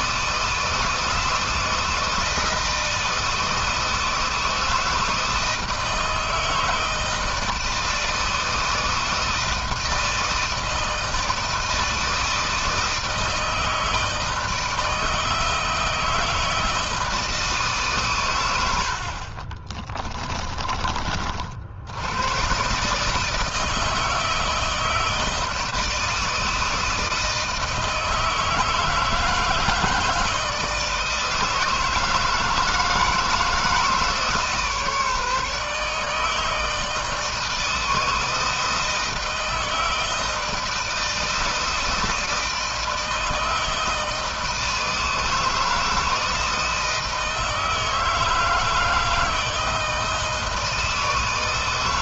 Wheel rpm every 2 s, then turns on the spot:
160, 160, 160, 160, 160, 160, 160, 160, 160, 60, 40, 140, 160, 160, 160, 160, 160, 150, 160, 160, 160, 160, 160, 160, 160, 160.
none